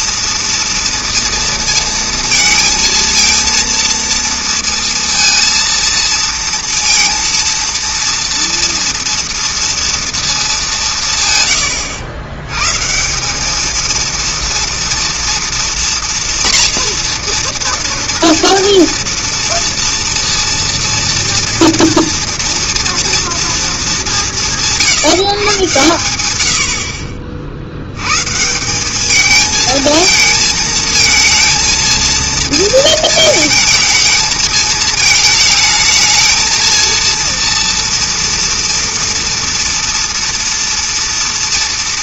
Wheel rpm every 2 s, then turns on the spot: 230, 230, 230, 230, 230, 190, 120, 230, 230, 230, 230, 230, 170, 90, 170, 220, 230, 220, 230, 230, 230.
none